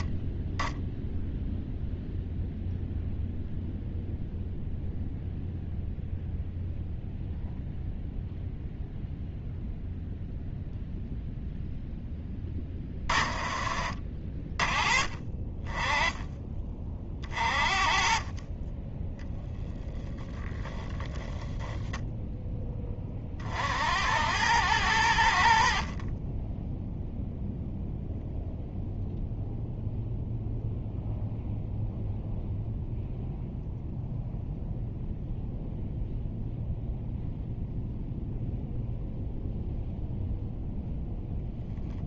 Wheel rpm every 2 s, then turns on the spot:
10, 0, 0, 0, 0, 0, 20, 40, 20, 30, 0, 10, 90, 10, 0, 0, 0, 0, 0, 0, 0.
none